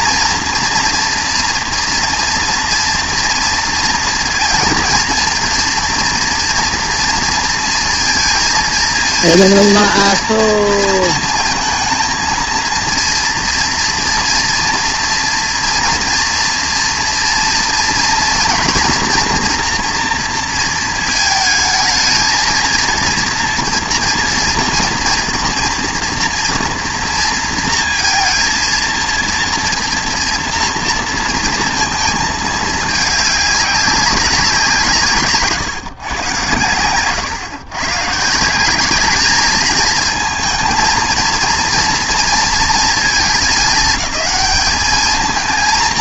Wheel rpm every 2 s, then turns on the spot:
230, 230, 230, 230, 230, 230, 230, 230, 230, 240, 230, 230, 240, 230, 230, 230, 220, 190, 110, 190, 230, 240, 210.
none